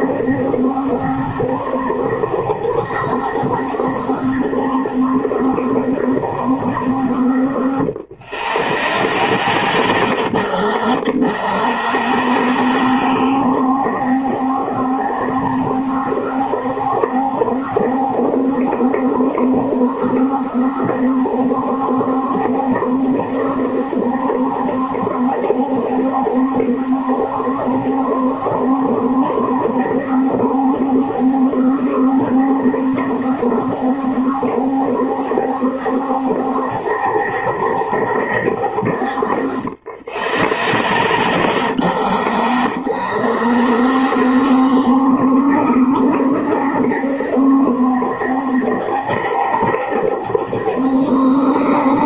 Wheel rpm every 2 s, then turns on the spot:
70, 70, 70, 70, 10, 40, 70, 70, 70, 70, 70, 70, 70, 70, 70, 70, 70, 70, 70, 60, 20, 50, 70, 70, 70, 70.
none